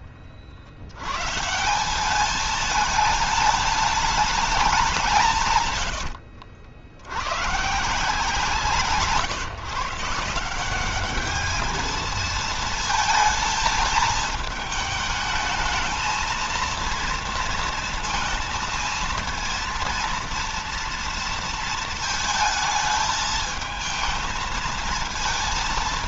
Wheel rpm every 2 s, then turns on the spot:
100, 210, 180, 80, 160, 200, 220, 220, 230, 230, 230, 220, 230.
none